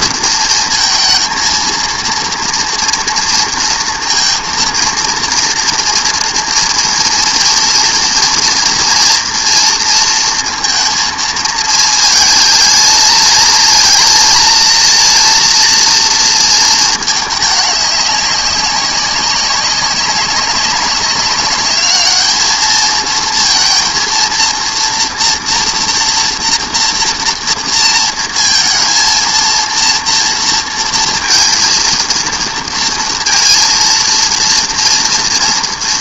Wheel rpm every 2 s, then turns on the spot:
230, 230, 230, 230, 230, 230, 220, 230, 230, 190, 190, 220, 230, 230, 230, 230, 230, 230.
none